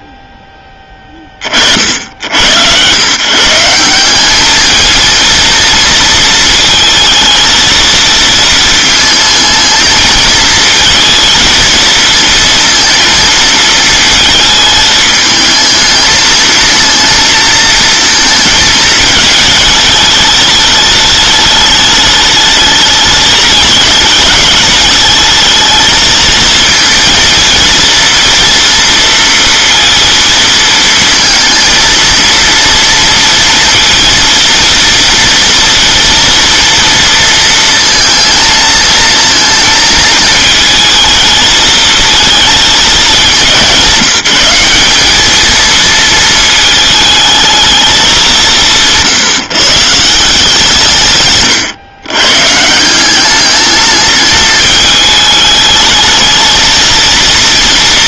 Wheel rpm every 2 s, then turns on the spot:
20, 100, 220, 220, 220, 220, 230, 220, 230, 220, 220, 210, 210, 220, 230, 220, 230, 230, 230, 220, 220, 220, 190, 220, 170, 160, 160, 220, 220.
none